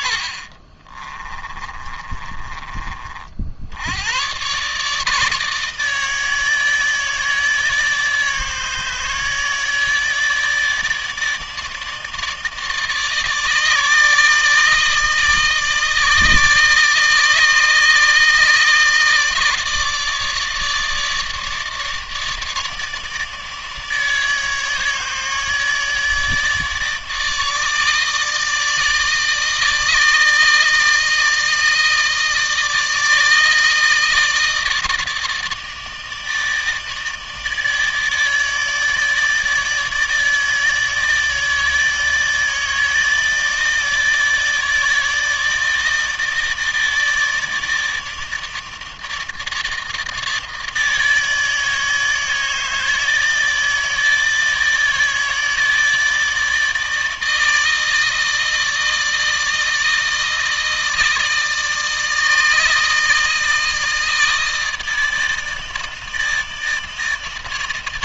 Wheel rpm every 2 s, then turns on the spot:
40, 30, 130, 150, 150, 150, 150, 150, 150, 150, 150, 150, 150, 150, 150, 160, 160, 160, 150, 160, 160, 160, 160, 160, 150, 160, 150, 160, 160, 160, 160, 160, 160, 160.
0-2